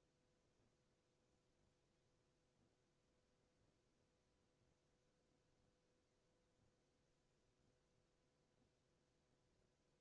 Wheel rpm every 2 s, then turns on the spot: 0, 0, 0, 0, 0.
none